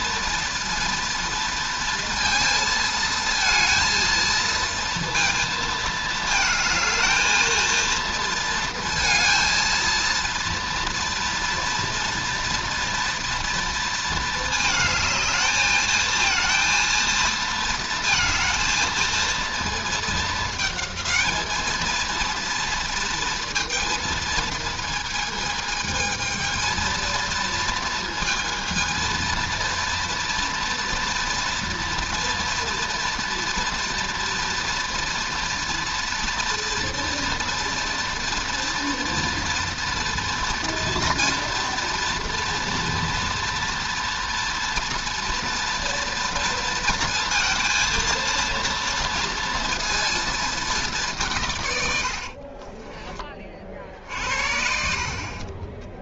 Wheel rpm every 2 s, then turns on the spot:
230, 230, 230, 230, 230, 240, 240, 220, 230, 230, 220, 230, 230, 220, 230, 230, 240, 240, 230, 230, 230, 230, 230, 230, 230, 200, 30, 60.
52-54